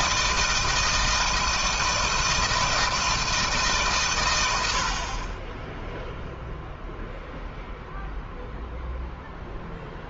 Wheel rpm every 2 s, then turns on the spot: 160, 160, 60, 0, 0.
none